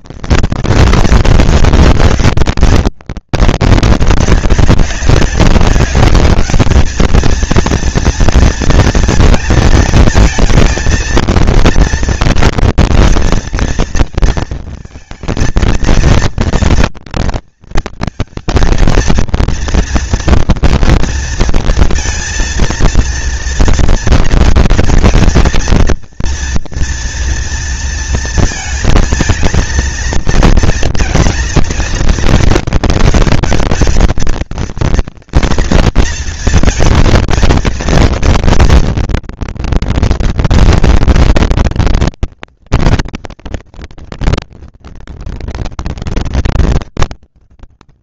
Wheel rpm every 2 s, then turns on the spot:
230, 200, 190, 210, 230, 220, 230, 230, 230, 220, 230, 230, 230, 230, 230, 230, 220, 230, 220, 230, 230, 230, 230, 210.
none